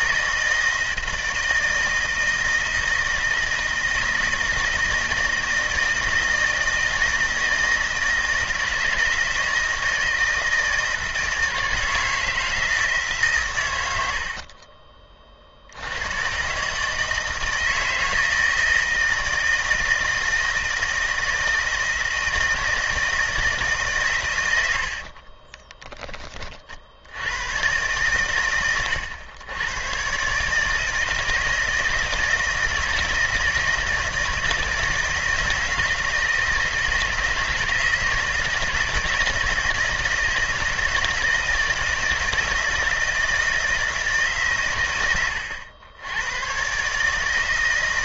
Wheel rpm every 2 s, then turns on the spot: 160, 160, 160, 160, 160, 160, 160, 40, 150, 160, 160, 160, 70, 70, 100, 160, 160, 160, 160, 160, 160, 160, 110, 140.
24-26